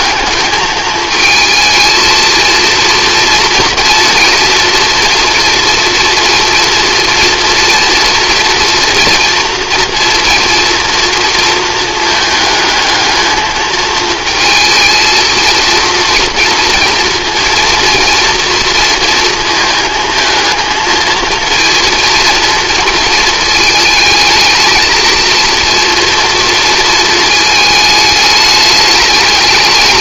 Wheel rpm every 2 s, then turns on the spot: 220, 230, 230, 230, 230, 230, 220, 230, 230, 230, 220, 230, 230, 230, 210.
none